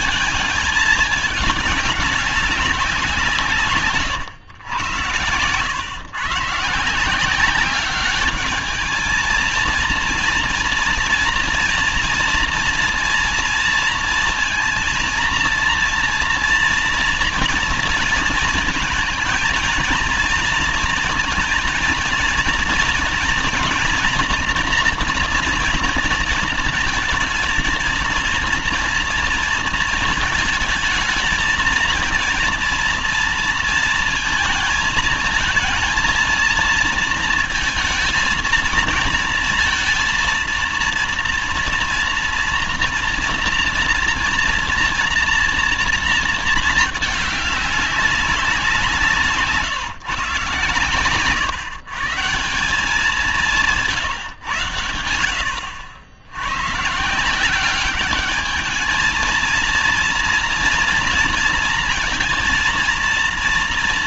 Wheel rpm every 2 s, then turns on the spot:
220, 200, 110, 150, 210, 230, 230, 230, 230, 220, 230, 230, 240, 230, 230, 220, 230, 230, 230, 230, 230, 230, 230, 220, 190, 140, 170, 120, 100, 210, 230, 230.
none